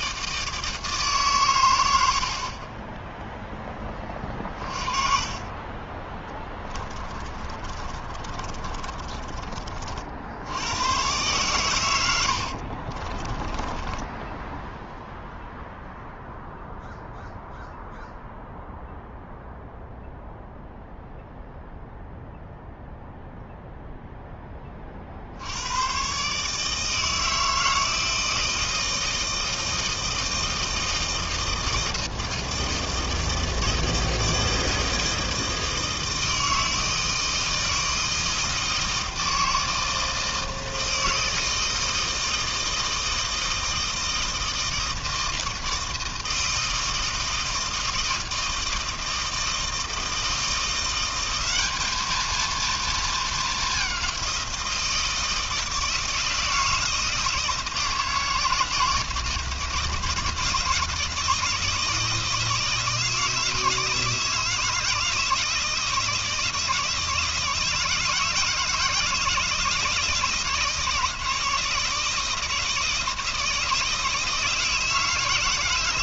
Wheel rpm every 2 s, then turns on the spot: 160, 30, 40, 20, 30, 90, 60, 0, 0, 0, 0, 0, 20, 150, 160, 160, 160, 160, 160, 160, 160, 160, 160, 160, 160, 170, 230, 170, 160, 160, 160, 160, 160, 160, 160, 160, 160, 160.
6-10 12-14